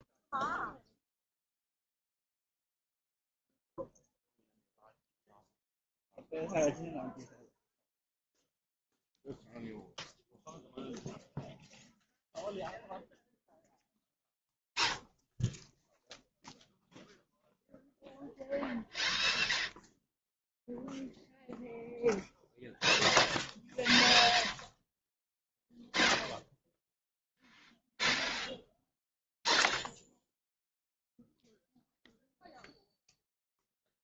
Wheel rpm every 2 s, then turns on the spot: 0, 0, 0, 0, 0, 0, 0, 0, 0, 0, 0, 0, 0, 0, 0, 0, 0.
none